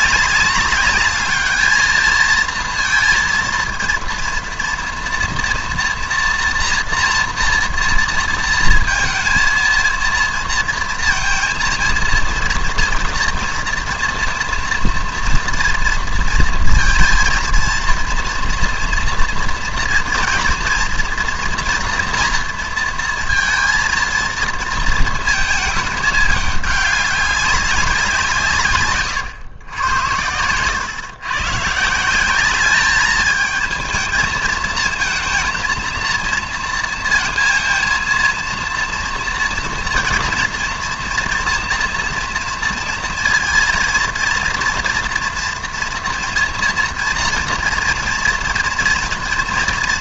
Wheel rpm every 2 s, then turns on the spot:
200, 230, 230, 230, 230, 230, 230, 230, 220, 240, 240, 230, 230, 210, 150, 100, 210, 220, 230, 230, 230, 230, 230, 230, 230.
30-32